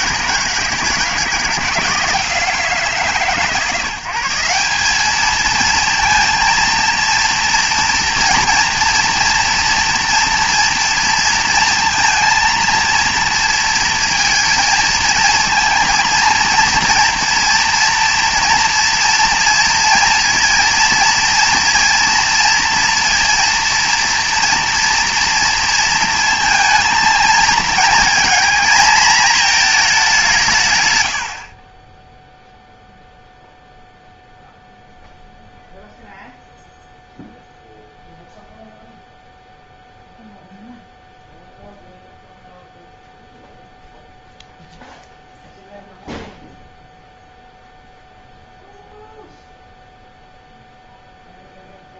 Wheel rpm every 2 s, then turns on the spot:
170, 160, 200, 230, 230, 230, 230, 230, 240, 230, 230, 230, 230, 220, 230, 110, 0, 0, 0, 0, 0, 0, 0, 0, 0, 0.
none